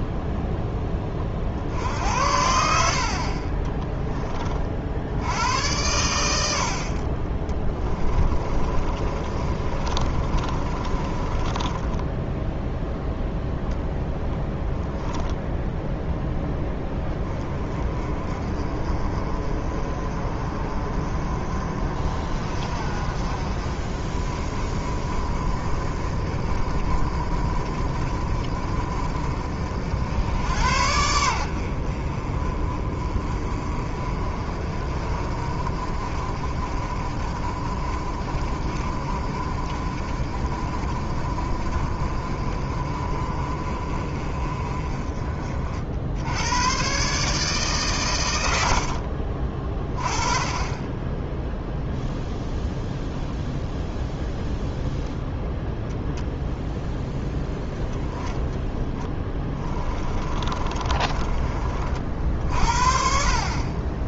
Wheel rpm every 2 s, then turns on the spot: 10, 70, 60, 60, 30, 30, 0, 0, 10, 30, 40, 40, 40, 40, 40, 80, 40, 40, 40, 40, 40, 40, 40, 120, 60, 30, 0, 0, 0, 10, 30, 50.
8-12 48-50 58-62